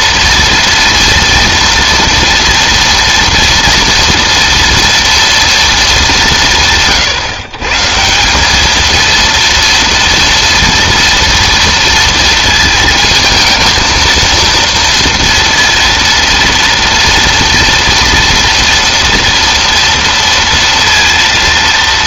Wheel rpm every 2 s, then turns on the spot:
230, 230, 230, 160, 210, 230, 220, 230, 230, 230, 230.
none